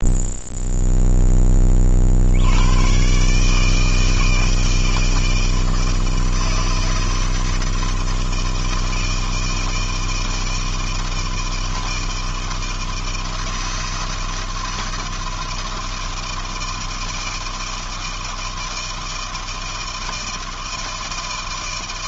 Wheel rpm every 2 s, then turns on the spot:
0, 120, 160, 160, 160, 160, 160, 160, 160, 160, 160.
none